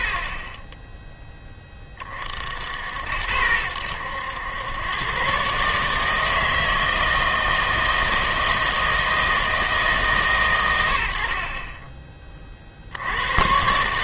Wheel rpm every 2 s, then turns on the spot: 10, 70, 110, 160, 160, 100, 50.
none